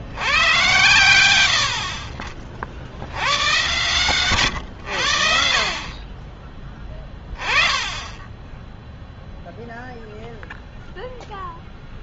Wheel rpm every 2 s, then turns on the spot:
100, 50, 120, 20, 10, 0.
none